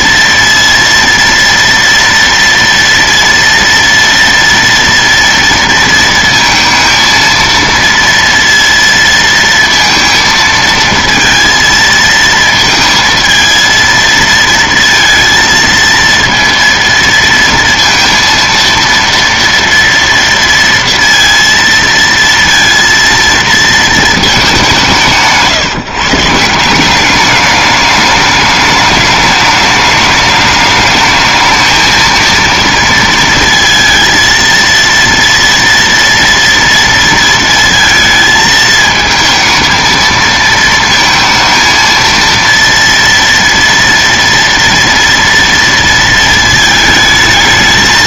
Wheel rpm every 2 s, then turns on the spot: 230, 230, 230, 230, 230, 220, 220, 230, 230, 230, 230, 230, 180, 170, 210, 210, 230, 230, 230, 220, 230, 230, 230, 220.
none